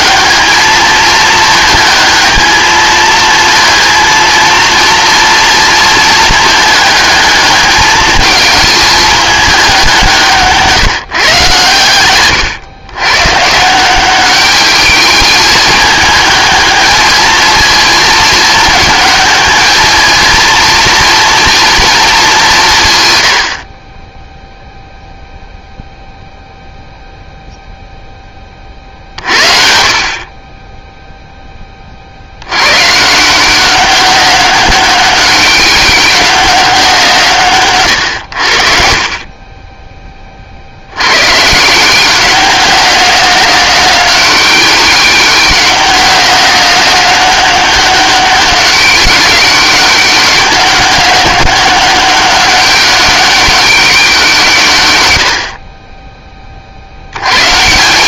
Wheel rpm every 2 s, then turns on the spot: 220, 220, 230, 220, 220, 160, 120, 210, 220, 220, 230, 150, 0, 0, 50, 10, 130, 200, 180, 50, 80, 180, 190, 190, 190, 190, 200, 110, 70.
none